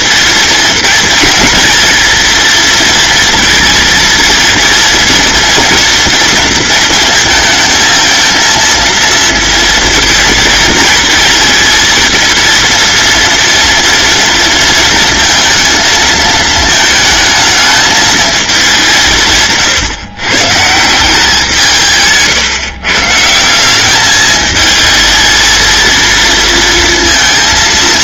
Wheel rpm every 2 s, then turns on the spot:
230, 230, 230, 230, 230, 220, 230, 230, 220, 180, 160, 130, 220, 230.
none